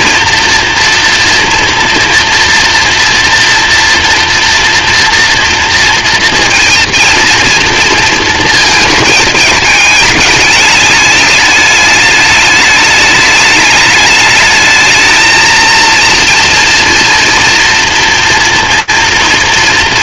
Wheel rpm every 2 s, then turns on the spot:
230, 230, 230, 230, 220, 210, 210, 220, 230, 230.
none